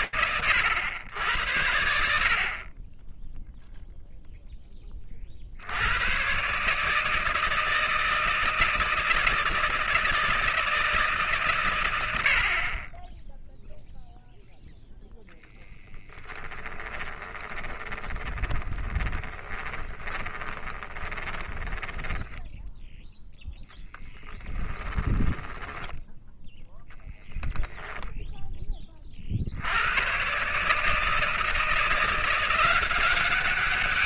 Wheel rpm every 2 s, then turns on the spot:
100, 10, 20, 150, 160, 160, 30, 0, 20, 20, 20, 10, 30, 10, 20, 150, 180.
16-22 24-26